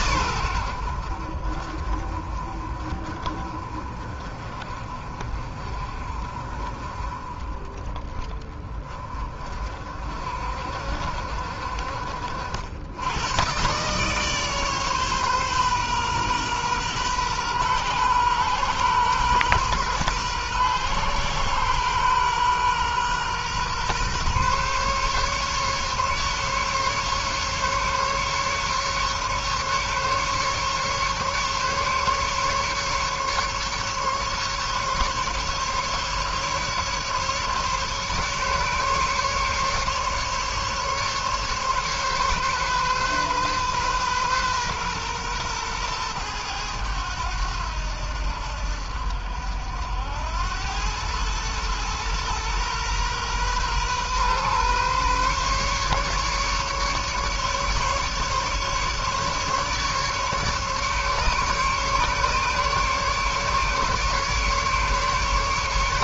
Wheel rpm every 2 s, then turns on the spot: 80, 40, 40, 40, 40, 60, 90, 140, 130, 120, 120, 130, 140, 140, 140, 140, 140, 140, 150, 140, 140, 130, 120, 100, 70, 100, 120, 130, 140, 140, 140, 140, 150.
none